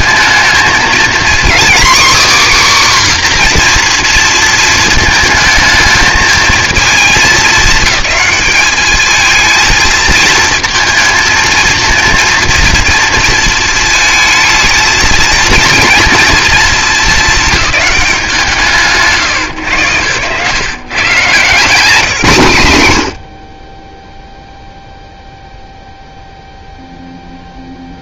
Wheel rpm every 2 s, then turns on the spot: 220, 270, 230, 220, 210, 230, 230, 220, 230, 180, 140, 130, 0, 0.
none